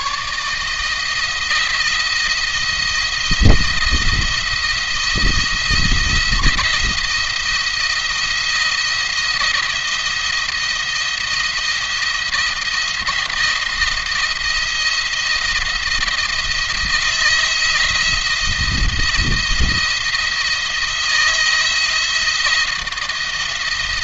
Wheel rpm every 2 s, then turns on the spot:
150, 170, 170, 170, 170, 170, 170, 170, 170, 170, 170, 170.
none